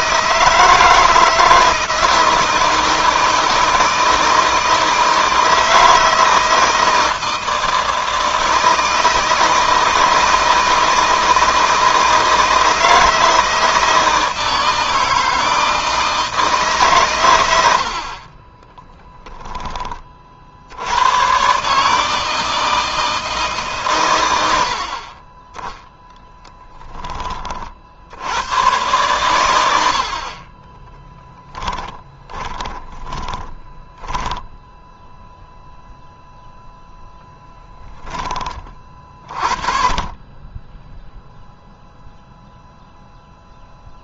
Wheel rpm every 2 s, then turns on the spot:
160, 170, 160, 160, 160, 160, 160, 160, 120, 10, 100, 160, 40, 20, 120, 20, 20, 0, 0, 40, 10, 0.
30-34